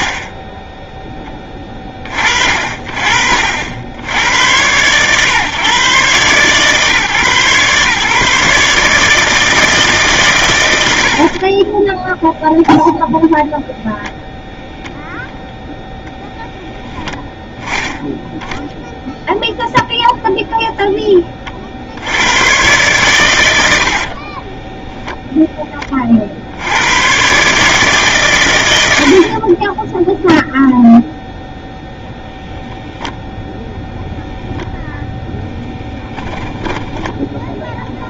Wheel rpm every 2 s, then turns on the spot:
0, 50, 100, 140, 150, 100, 0, 0, 0, 0, 0, 110, 20, 70, 110, 0, 0, 0, 20.
24-26 36-38